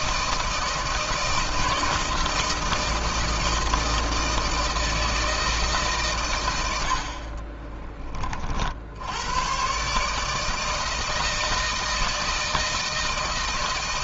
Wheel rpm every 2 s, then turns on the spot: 160, 160, 160, 100, 40, 160, 160.
none